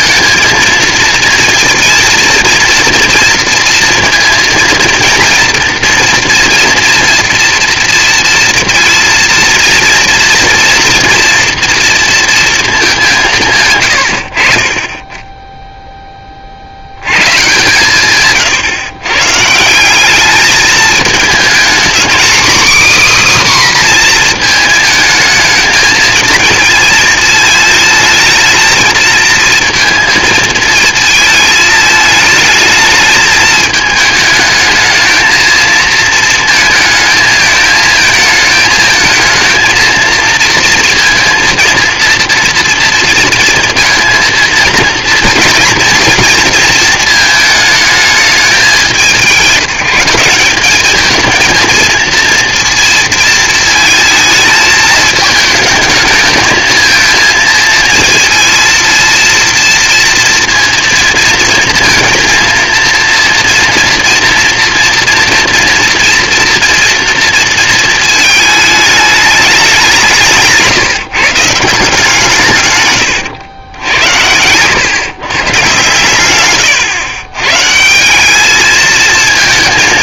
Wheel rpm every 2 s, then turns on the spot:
230, 230, 230, 230, 230, 230, 210, 30, 50, 130, 210, 280, 220, 220, 230, 220, 220, 220, 220, 220, 230, 230, 230, 230, 200, 200, 230, 220, 220, 230, 230, 230, 240, 230, 220, 160, 140, 110, 120, 210.
76-78